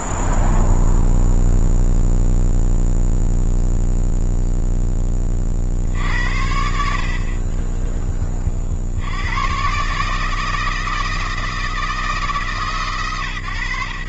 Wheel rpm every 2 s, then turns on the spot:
0, 0, 0, 60, 20, 150, 160.
none